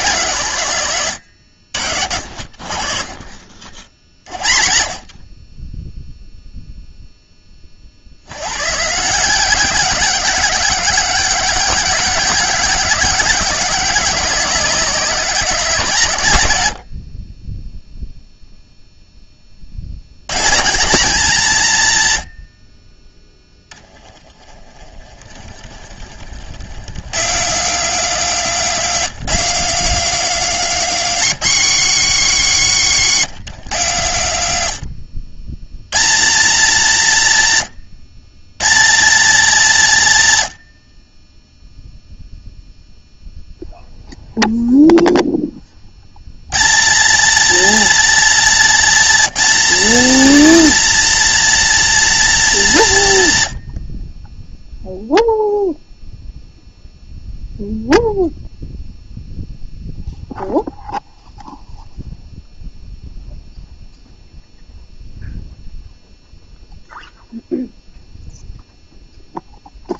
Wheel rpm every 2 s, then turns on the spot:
140, 50, 50, 0, 130, 200, 200, 190, 100, 0, 170, 40, 20, 120, 230, 240, 200, 120, 190, 160, 80, 0, 0, 170, 230, 250, 210, 0, 0, 0, 0, 0, 0, 0, 0.
24-26 28-30 48-50